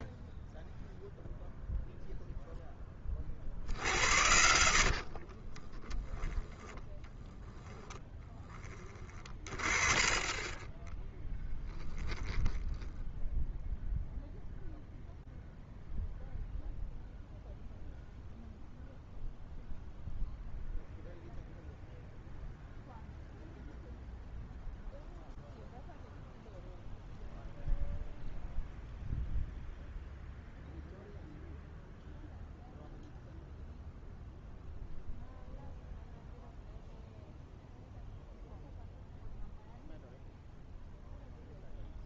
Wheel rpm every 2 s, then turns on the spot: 0, 30, 50, 10, 30, 10, 10, 0, 0, 0, 0, 0, 0, 0, 0, 0, 0, 0, 0, 0, 0.
4-8